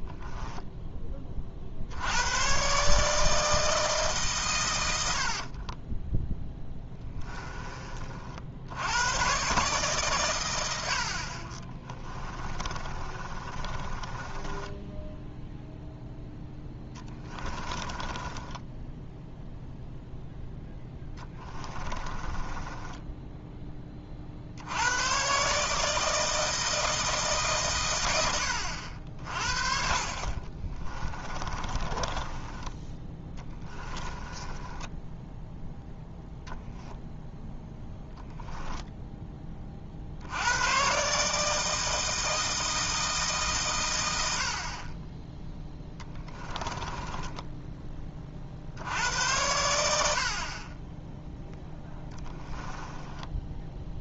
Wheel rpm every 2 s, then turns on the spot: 10, 140, 90, 10, 90, 60, 30, 10, 10, 10, 10, 10, 90, 160, 60, 20, 10, 10, 0, 10, 120, 160, 30, 20, 70, 10, 10.
6-8 12-24 30-32 34-36 46-48 52-54